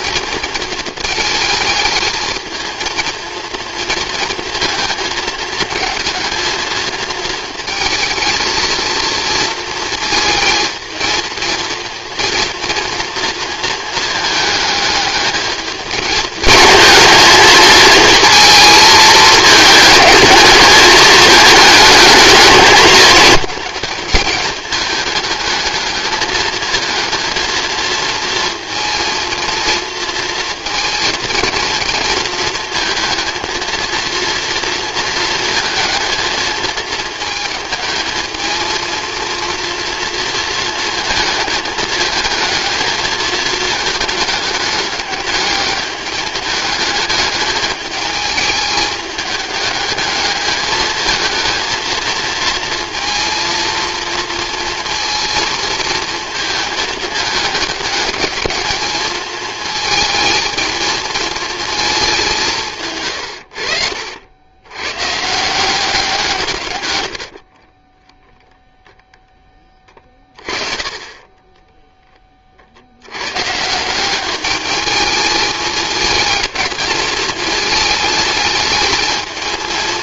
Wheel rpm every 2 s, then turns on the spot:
230, 220, 230, 220, 230, 230, 230, 220, 220, 230, 220, 220, 210, 220, 220, 230, 230, 230, 220, 220, 230, 220, 210, 210, 210, 220, 230, 230, 230, 220, 220, 160, 90, 150, 0, 20, 50, 210, 220, 220.
none